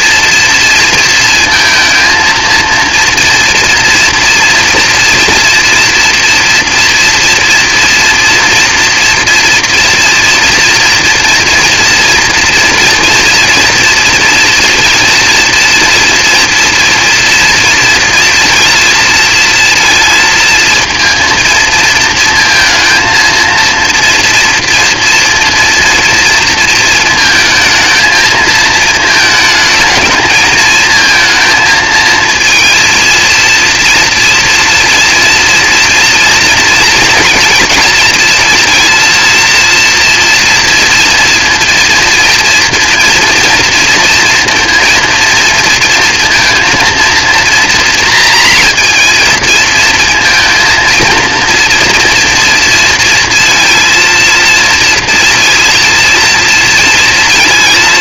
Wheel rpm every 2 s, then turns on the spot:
230, 230, 230, 240, 240, 240, 240, 230, 230, 230, 230, 230, 230, 230, 220, 220, 230, 230, 230, 230, 230, 230, 230, 230, 230, 230, 230, 230, 230.
none